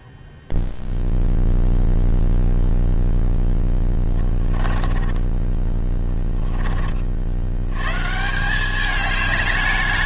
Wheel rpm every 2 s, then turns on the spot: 0, 0, 10, 20, 180.
4-6